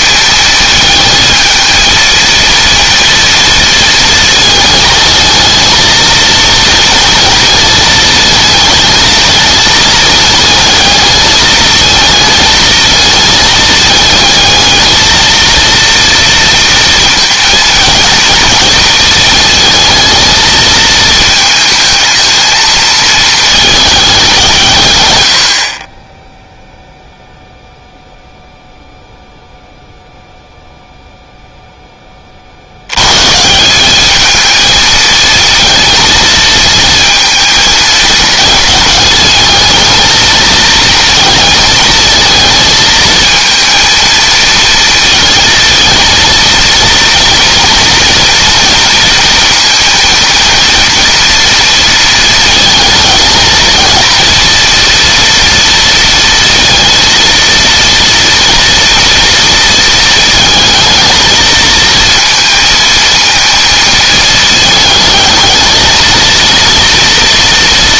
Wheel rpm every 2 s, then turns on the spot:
220, 230, 220, 230, 220, 220, 220, 220, 230, 220, 220, 220, 130, 0, 0, 0, 80, 220, 220, 220, 220, 220, 230, 230, 230, 240, 220, 230, 230, 230, 220, 230, 220, 230.
none